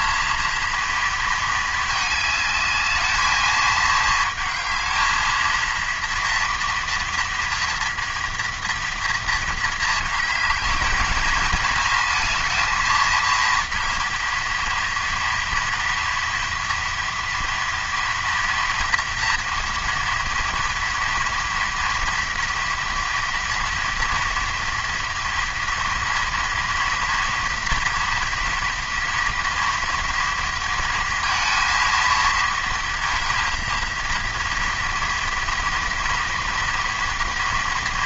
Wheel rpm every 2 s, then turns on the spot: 230, 210, 220, 230, 230, 220, 220, 230, 230, 230, 230, 230, 230, 230, 230, 230, 230, 230, 230.
none